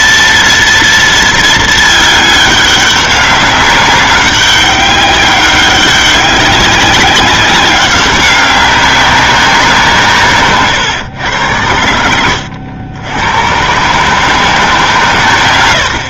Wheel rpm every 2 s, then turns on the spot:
230, 200, 200, 190, 190, 140, 80, 160.
none